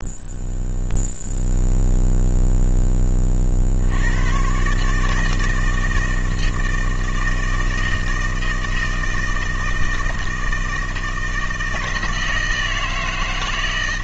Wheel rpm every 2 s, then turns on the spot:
0, 10, 140, 160, 160, 160, 160.
none